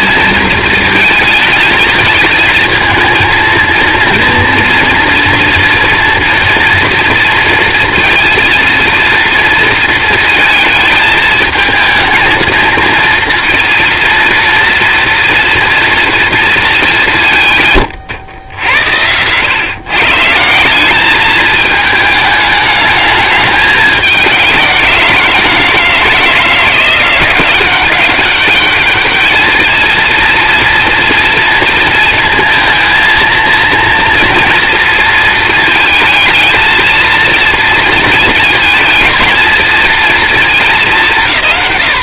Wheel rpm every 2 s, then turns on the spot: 220, 220, 230, 230, 230, 220, 230, 230, 220, 90, 190, 210, 180, 170, 210, 230, 230, 230, 220, 220, 210.
none